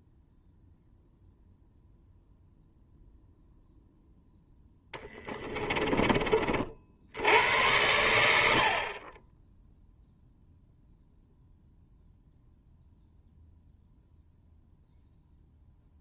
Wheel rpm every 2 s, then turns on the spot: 0, 0, 10, 50, 50, 0, 0, 0.
4-6